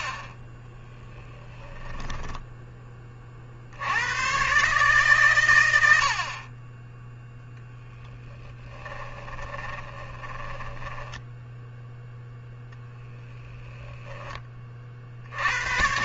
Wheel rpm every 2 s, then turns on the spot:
20, 20, 140, 20, 10, 10, 10, 40.
0-2 8-14